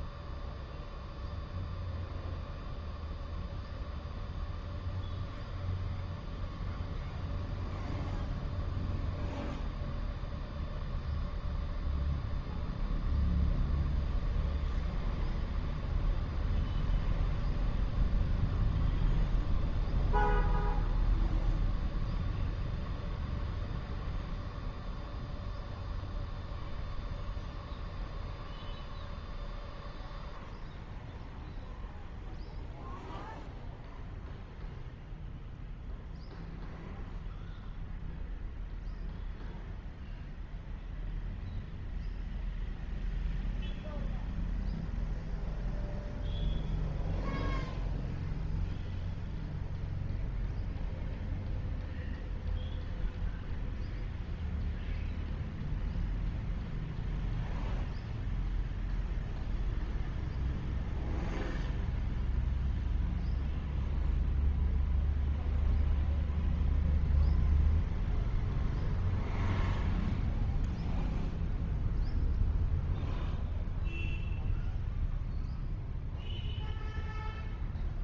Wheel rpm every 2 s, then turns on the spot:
0, 0, 0, 0, 0, 0, 0, 0, 0, 0, 0, 0, 0, 0, 0, 0, 0, 0, 0, 0, 0, 0, 0, 0, 0, 0, 0, 0, 0, 0, 0, 0, 0, 0, 0, 0, 0, 0, 0.
none